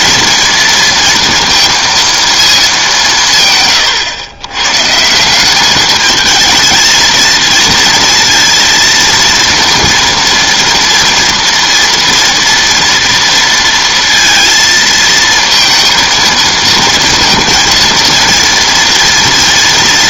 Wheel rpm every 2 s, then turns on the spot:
230, 220, 110, 220, 230, 230, 230, 230, 230, 230.
none